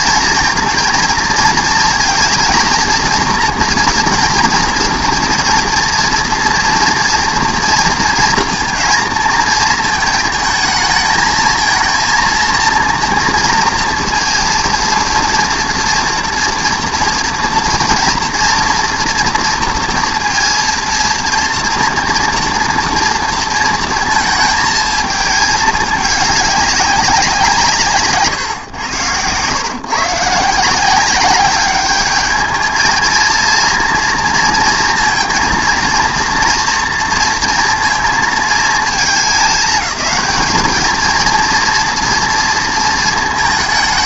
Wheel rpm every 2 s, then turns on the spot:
230, 230, 230, 230, 230, 220, 230, 230, 230, 230, 230, 240, 220, 200, 120, 160, 210, 230, 230, 220, 220, 230.
none